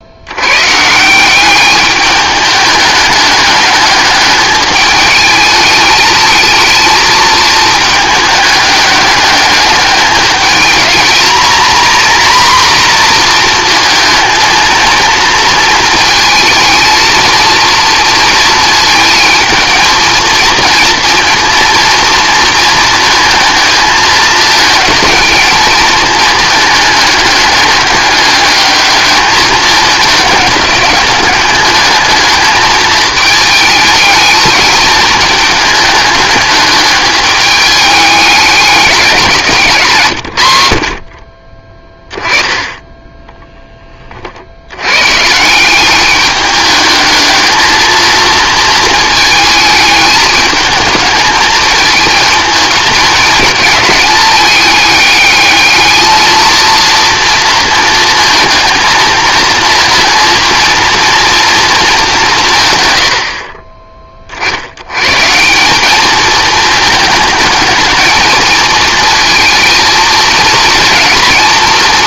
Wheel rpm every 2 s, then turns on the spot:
140, 210, 210, 220, 210, 220, 240, 220, 230, 230, 230, 220, 220, 210, 210, 200, 220, 210, 210, 190, 60, 20, 90, 210, 230, 220, 220, 210, 230, 220, 230, 140, 80, 220, 220, 220.
42-44